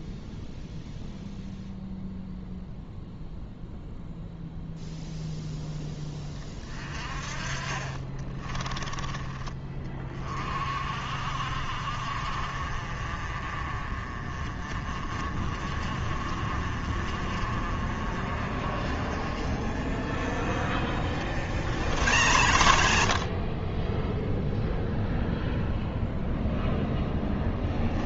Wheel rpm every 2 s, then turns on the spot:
0, 0, 0, 30, 20, 50, 40, 30, 40, 40, 40, 70, 0, 0.
none